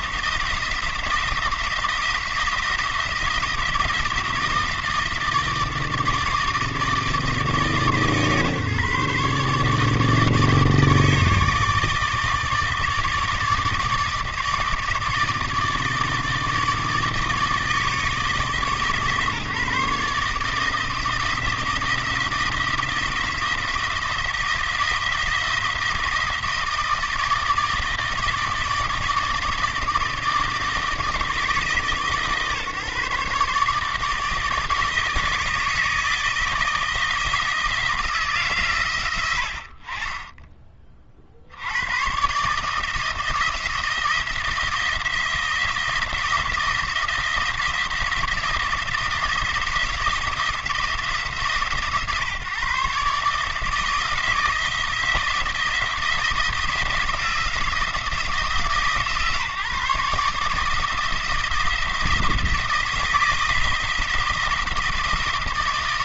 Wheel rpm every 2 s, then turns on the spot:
170, 170, 160, 160, 140, 150, 160, 160, 160, 150, 160, 170, 170, 160, 160, 160, 150, 160, 160, 130, 30, 160, 170, 170, 170, 160, 140, 160, 170, 160, 160, 160, 170.
none